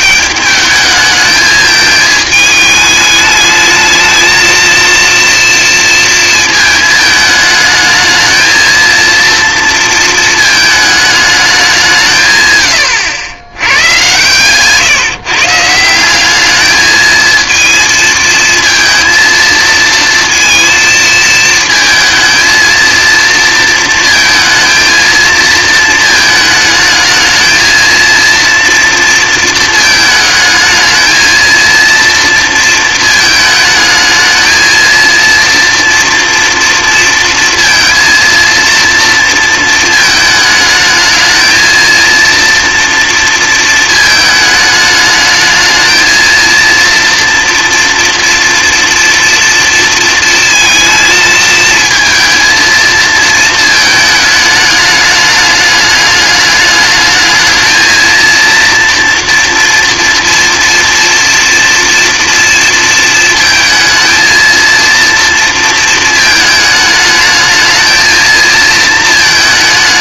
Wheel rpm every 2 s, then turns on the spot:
210, 210, 230, 220, 220, 220, 120, 140, 210, 230, 230, 230, 230, 220, 230, 220, 230, 220, 230, 230, 220, 230, 210, 230, 230, 220, 230, 210, 210, 230, 240, 230, 230, 220, 230.
none